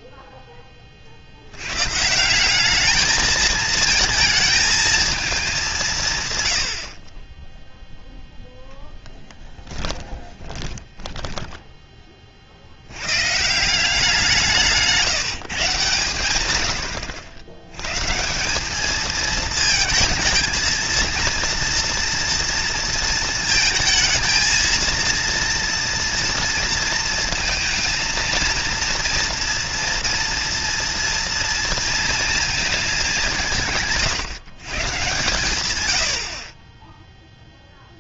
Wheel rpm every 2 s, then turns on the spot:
20, 210, 220, 70, 0, 10, 70, 160, 100, 190, 230, 230, 230, 230, 230, 230, 220, 130, 30.
10-12